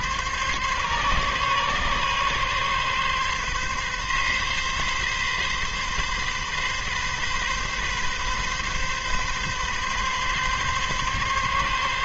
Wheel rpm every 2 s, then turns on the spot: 140, 140, 130, 140, 140, 140.
none